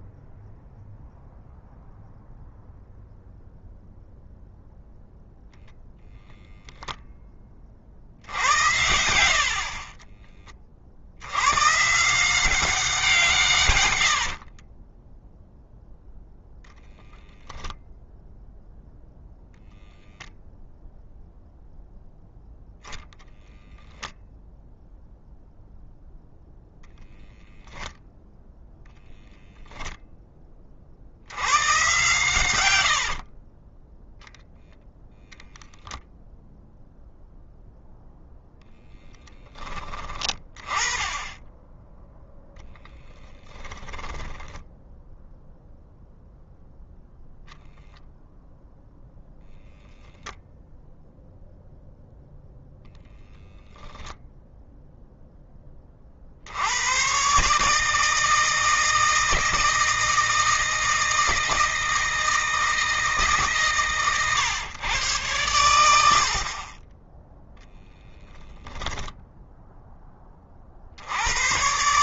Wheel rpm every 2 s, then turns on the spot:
0, 0, 0, 0, 90, 50, 160, 20, 0, 0, 0, 0, 0, 0, 0, 50, 80, 0, 0, 10, 20, 0, 0, 0, 0, 0, 0, 0, 100, 160, 160, 160, 110, 20, 20, 70.
8-10 14-16 32-34